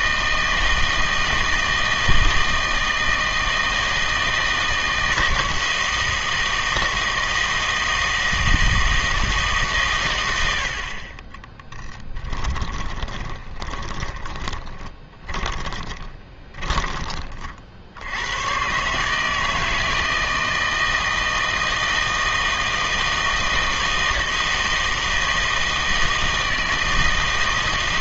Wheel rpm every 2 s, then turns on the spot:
160, 160, 160, 160, 160, 70, 20, 20, 20, 120, 160, 160, 160, 160.
12-18